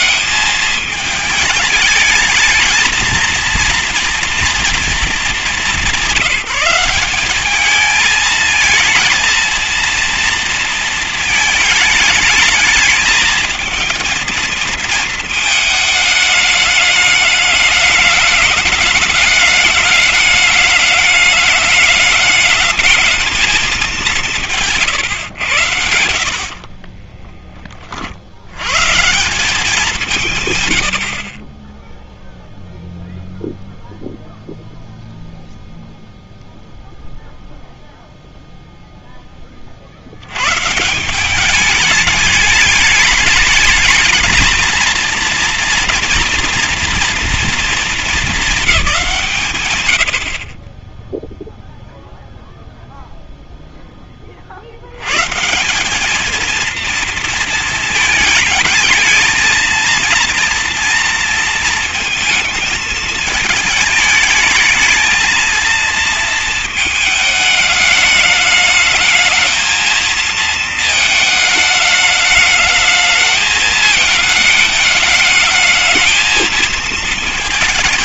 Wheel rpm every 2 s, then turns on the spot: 210, 220, 230, 170, 220, 230, 220, 220, 210, 210, 210, 210, 150, 40, 110, 110, 0, 0, 0, 0, 130, 210, 230, 230, 200, 40, 0, 60, 230, 220, 240, 220, 220, 220, 210, 220, 210, 210, 220.
24-28